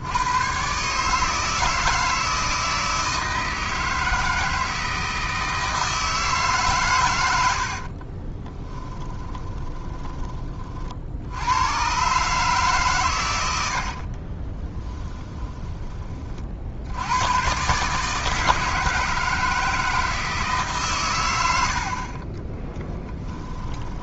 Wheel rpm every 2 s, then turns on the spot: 130, 160, 160, 140, 10, 50, 130, 20, 70, 160, 140, 10.
8-10 14-16 22-24